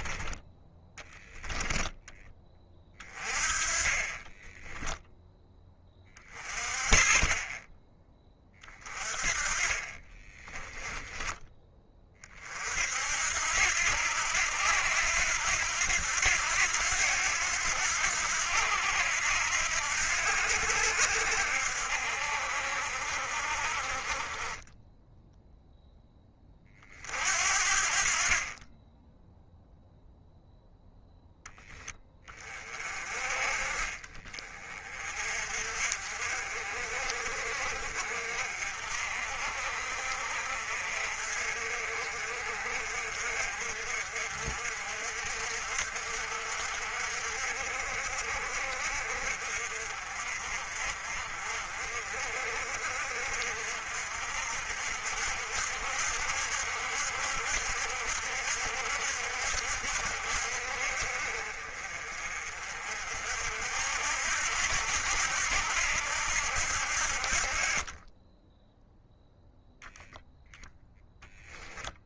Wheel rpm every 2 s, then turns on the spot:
10, 30, 10, 30, 30, 20, 60, 90, 90, 80, 80, 60, 10, 40, 10, 0, 30, 40, 50, 50, 50, 50, 50, 60, 50, 50, 50, 60, 70, 60, 50, 50, 80, 60, 0, 0.
10-12